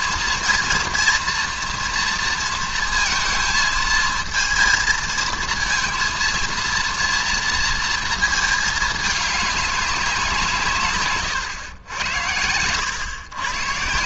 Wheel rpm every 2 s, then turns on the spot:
230, 230, 230, 230, 220, 170, 100.
none